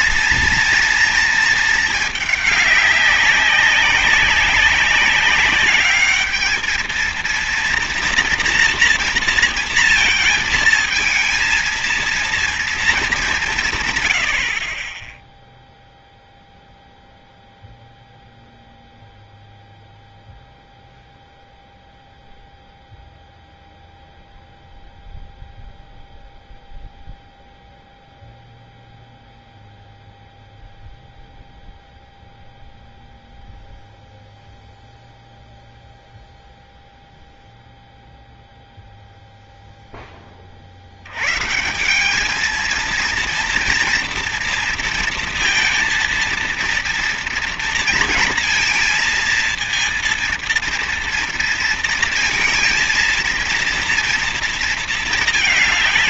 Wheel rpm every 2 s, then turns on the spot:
230, 210, 200, 220, 230, 230, 230, 60, 0, 0, 0, 0, 0, 0, 0, 0, 0, 0, 0, 0, 50, 220, 230, 230, 230, 230, 230, 230.
none